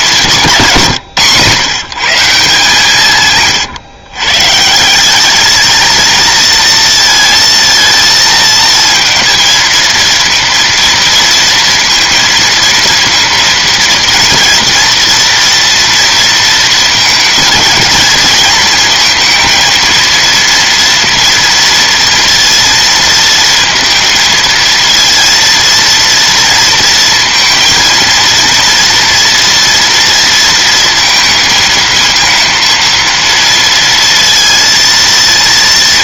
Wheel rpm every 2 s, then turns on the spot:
160, 150, 160, 230, 230, 230, 230, 230, 220, 230, 230, 230, 230, 230, 230, 220, 230, 230.
none